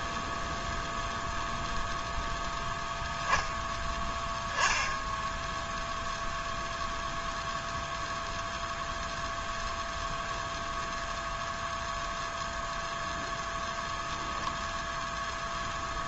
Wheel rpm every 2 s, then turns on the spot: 0, 0, 0, 0, 0, 0, 0, 0.
none